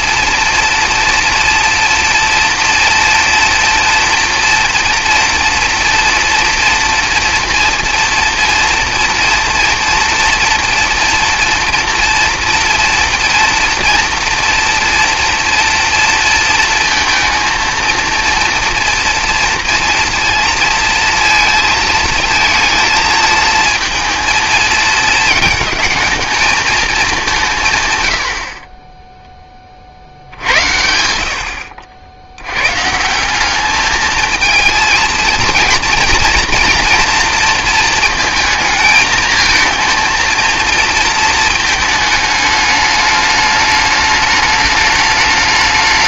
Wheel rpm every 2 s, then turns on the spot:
230, 240, 230, 230, 230, 230, 230, 230, 230, 230, 230, 220, 230, 220, 20, 80, 130, 230, 230, 220, 230, 210, 210.
none